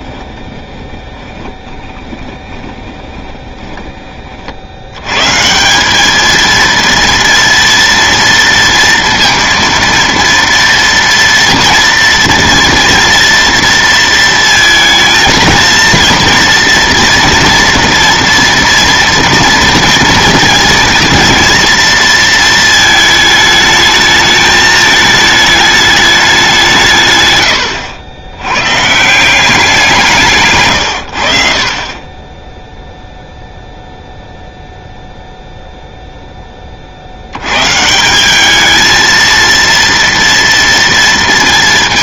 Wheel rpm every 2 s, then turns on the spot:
20, 20, 80, 230, 230, 230, 230, 230, 230, 230, 220, 220, 220, 180, 110, 140, 10, 0, 20, 210, 230.
0-4